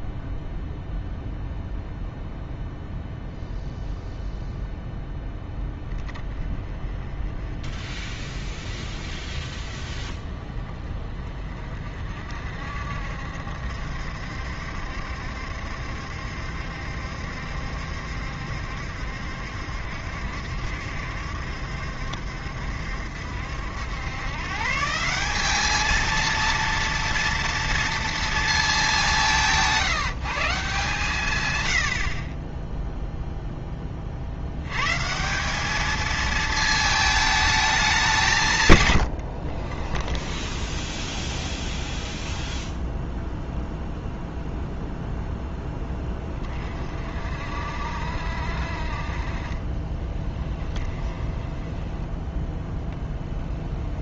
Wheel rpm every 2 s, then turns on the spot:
0, 0, 0, 20, 30, 30, 60, 70, 70, 70, 70, 70, 140, 230, 200, 140, 0, 110, 220, 130, 20, 0, 0, 40, 60, 10, 0.
40-42 50-52